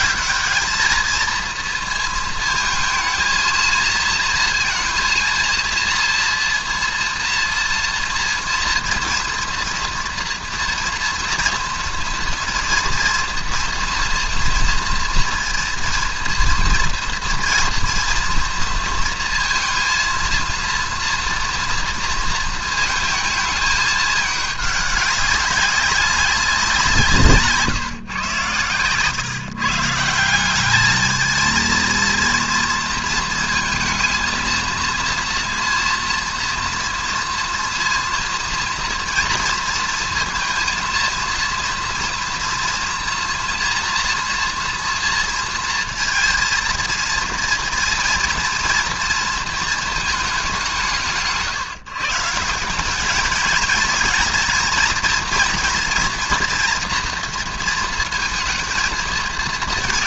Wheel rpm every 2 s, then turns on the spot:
220, 220, 230, 230, 230, 230, 230, 230, 230, 230, 230, 230, 210, 190, 120, 200, 230, 230, 230, 230, 230, 230, 230, 230, 230, 180, 180, 230, 230, 220.
none